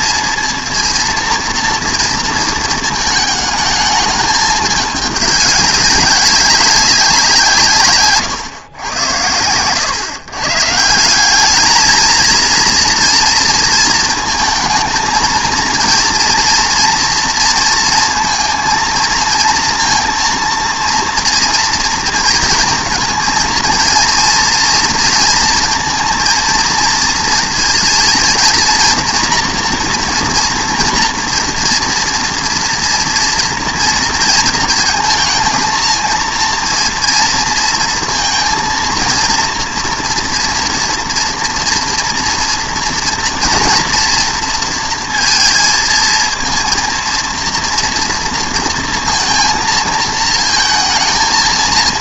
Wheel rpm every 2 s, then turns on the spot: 230, 220, 210, 190, 100, 170, 230, 230, 230, 230, 230, 230, 230, 230, 230, 240, 230, 220, 230, 230, 230, 230, 230, 230, 230, 230.
none